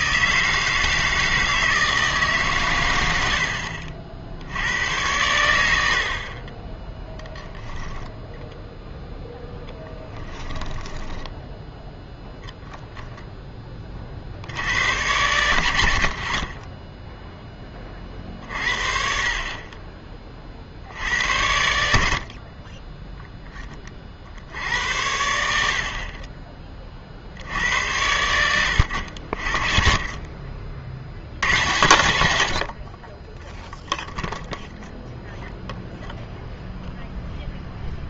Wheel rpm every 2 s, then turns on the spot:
160, 120, 90, 10, 0, 10, 10, 100, 20, 50, 60, 30, 80, 30, 80, 50, 60, 0, 0.
10-14